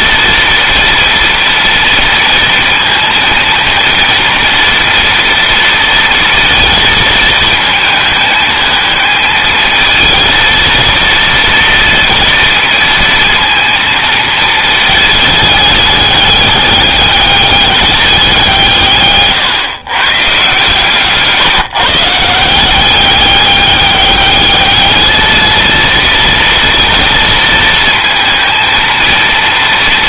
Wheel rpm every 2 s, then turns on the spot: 230, 230, 230, 230, 220, 230, 230, 220, 200, 160, 140, 190, 210, 230, 230.
none